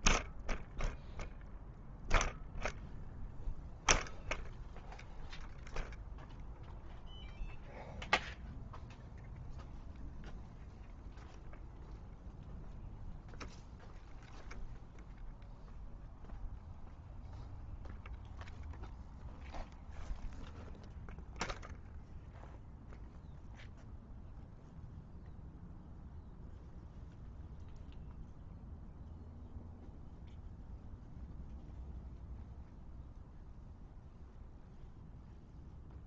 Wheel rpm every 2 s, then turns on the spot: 0, 0, 0, 0, 0, 0, 0, 0, 0, 0, 0, 0, 0, 0, 0, 0, 0, 0.
none